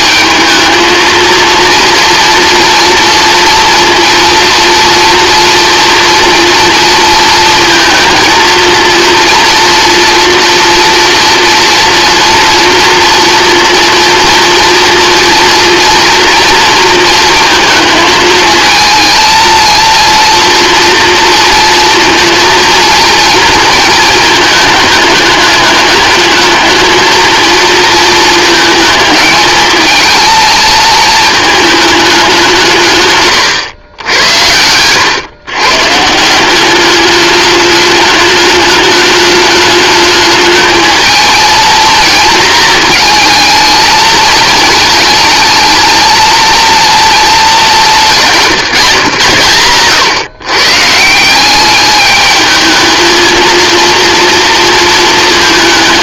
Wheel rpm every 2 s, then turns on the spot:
220, 230, 230, 230, 230, 230, 230, 230, 230, 220, 230, 230, 210, 220, 220, 220, 160, 100, 200, 210, 220, 230, 220, 230, 170, 150, 220, 230.
none